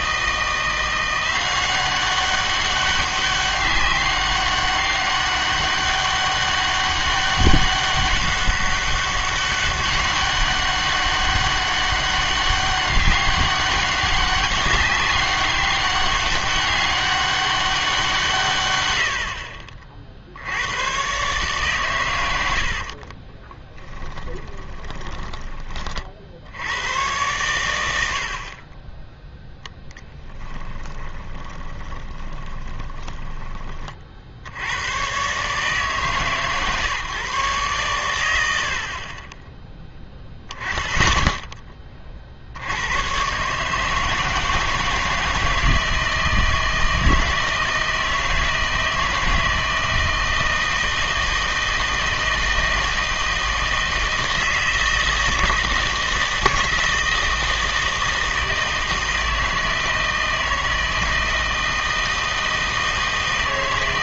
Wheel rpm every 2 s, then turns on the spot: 170, 200, 200, 200, 200, 200, 200, 190, 200, 120, 90, 70, 20, 80, 40, 10, 20, 80, 150, 70, 10, 80, 160, 160, 160, 160, 160, 160, 160, 160, 160, 160.
22-26 30-34